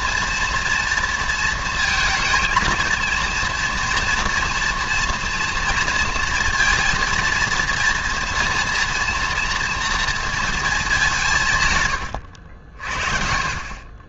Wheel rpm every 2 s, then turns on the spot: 230, 220, 230, 230, 230, 220, 60.
none